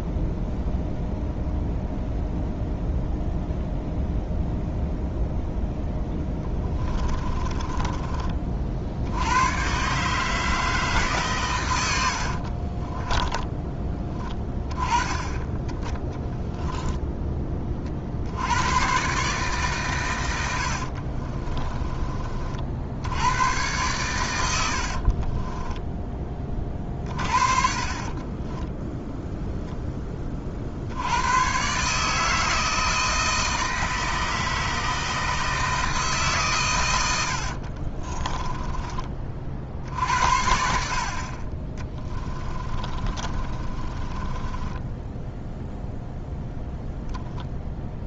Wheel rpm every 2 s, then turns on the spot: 0, 0, 0, 20, 60, 160, 40, 10, 0, 110, 70, 60, 70, 40, 10, 70, 160, 160, 100, 20, 60, 30, 10, 0.
6-8 12-14 20-22 24-26 28-30 42-46